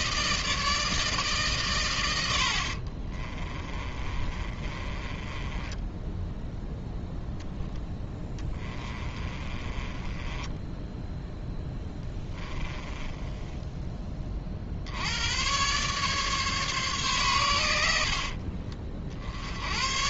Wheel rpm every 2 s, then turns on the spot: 160, 50, 30, 10, 20, 10, 10, 60, 140, 50.
2-6 8-14